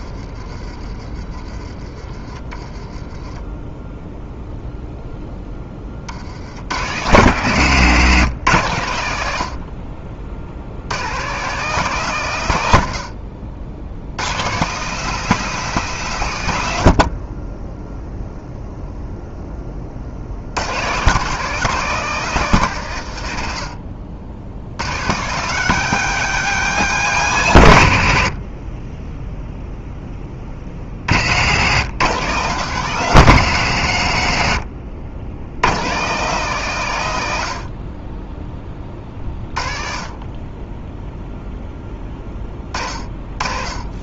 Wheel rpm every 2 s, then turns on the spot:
30, 20, 0, 100, 120, 90, 100, 140, 110, 0, 110, 140, 80, 190, 40, 40, 140, 70, 150, 20, 20, 30.
none